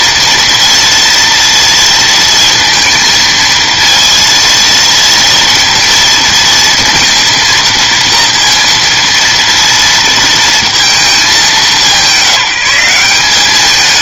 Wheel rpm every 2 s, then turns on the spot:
240, 230, 230, 230, 230, 210, 180.
none